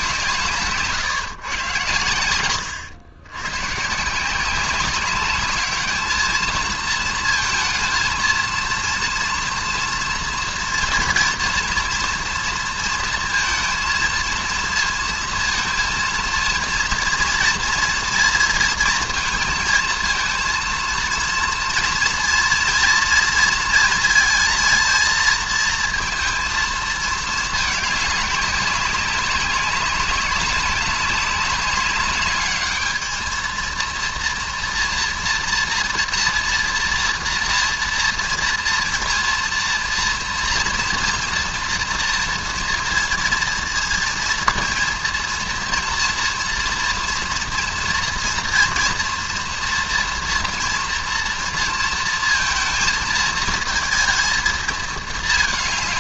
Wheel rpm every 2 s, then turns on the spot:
150, 100, 190, 220, 230, 240, 230, 230, 230, 230, 230, 230, 230, 220, 190, 200, 210, 230, 240, 230, 230, 230, 230, 230, 230, 230, 230, 220.
2-4